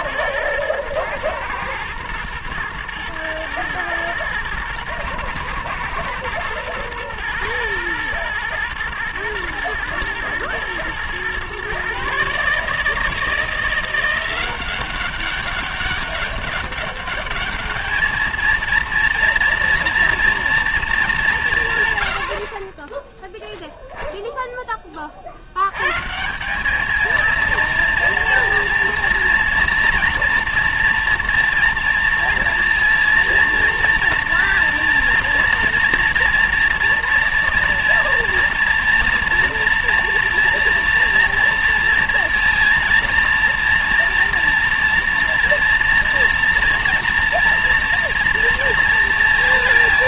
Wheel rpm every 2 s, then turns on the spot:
110, 110, 110, 110, 110, 110, 150, 180, 200, 230, 230, 50, 10, 190, 230, 230, 230, 230, 230, 230, 230, 230, 230, 230, 230.
none